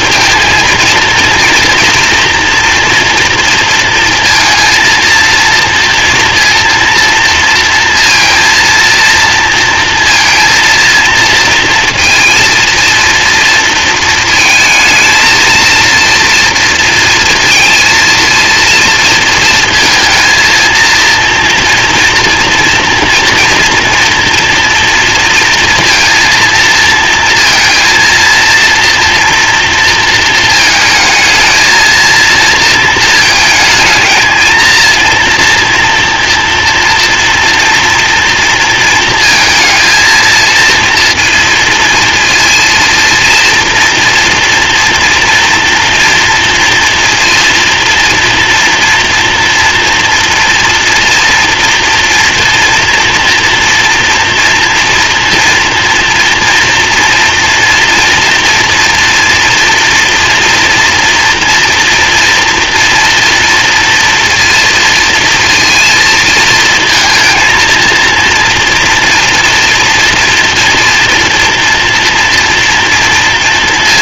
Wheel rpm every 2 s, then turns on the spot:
230, 240, 230, 230, 230, 230, 230, 220, 230, 230, 230, 230, 230, 230, 230, 220, 230, 230, 230, 230, 230, 230, 240, 240, 230, 230, 230, 230, 230, 240, 230, 230, 230, 230, 230, 230, 240.
none